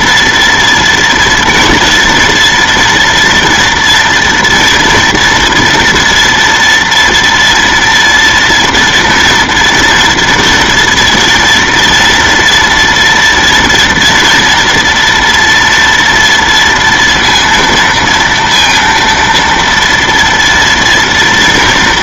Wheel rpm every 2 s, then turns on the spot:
230, 240, 230, 230, 240, 230, 230, 230, 230, 230, 230.
none